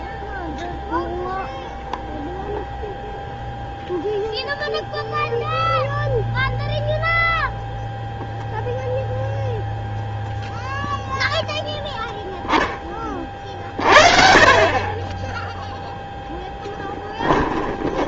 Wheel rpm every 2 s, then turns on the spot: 0, 0, 0, 0, 0, 0, 0, 40, 10.
16-18